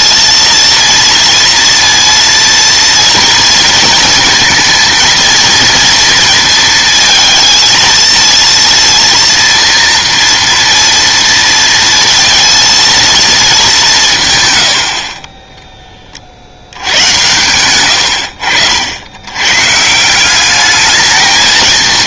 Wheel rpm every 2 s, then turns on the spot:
230, 230, 230, 230, 230, 230, 230, 110, 70, 70, 200.
none